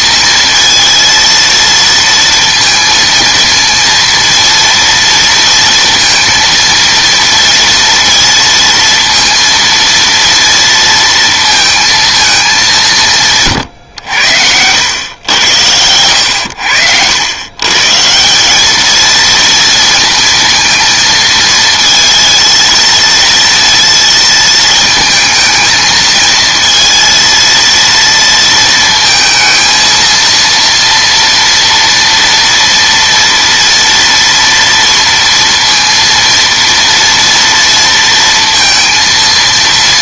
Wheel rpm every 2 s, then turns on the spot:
230, 230, 230, 230, 230, 230, 190, 90, 90, 210, 230, 230, 220, 230, 230, 230, 230, 230, 230, 230.
none